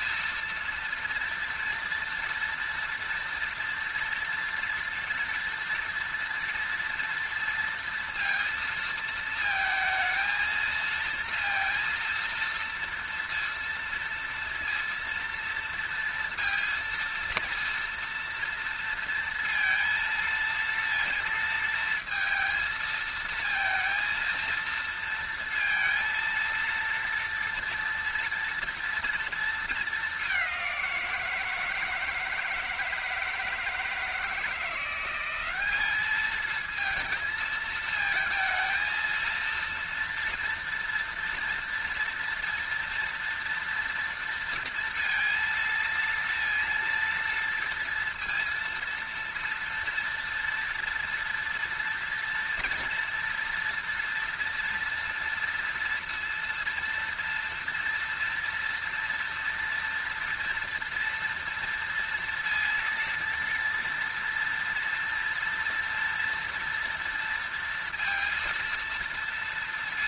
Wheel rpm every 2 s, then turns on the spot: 230, 230, 230, 230, 230, 230, 230, 230, 230, 230, 230, 230, 230, 230, 230, 190, 160, 170, 220, 220, 230, 230, 230, 230, 230, 230, 230, 230, 230, 230, 230, 230, 230, 230, 230.
none